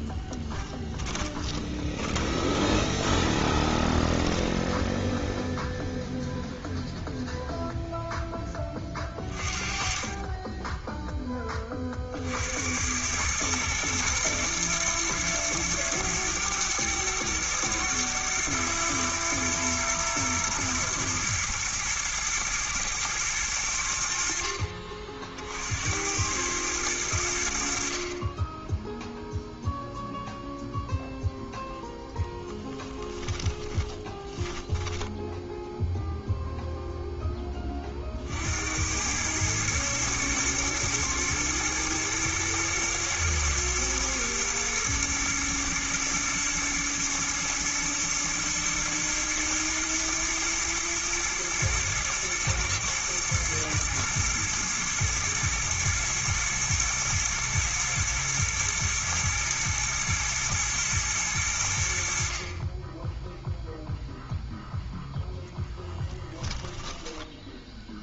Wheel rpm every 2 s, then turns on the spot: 10, 20, 0, 0, 20, 10, 90, 120, 110, 120, 110, 120, 50, 100, 10, 0, 10, 10, 0, 90, 120, 110, 110, 110, 110, 120, 110, 120, 110, 110, 110, 30, 0, 10.
0-4 32-36 66-68